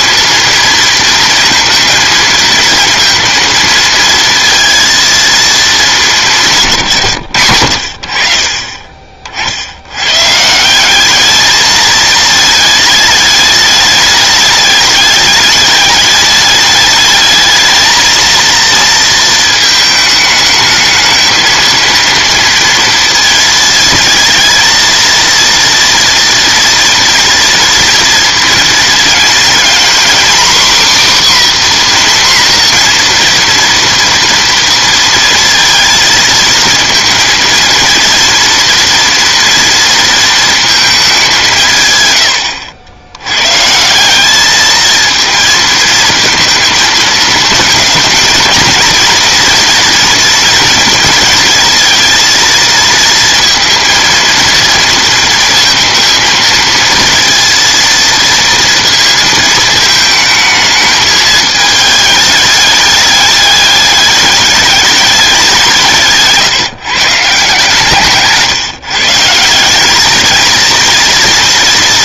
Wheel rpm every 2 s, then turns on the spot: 230, 230, 230, 160, 30, 160, 220, 210, 210, 230, 210, 230, 230, 230, 230, 260, 250, 230, 230, 230, 220, 90, 220, 230, 220, 230, 230, 230, 230, 230, 220, 210, 210, 150, 150, 230.
none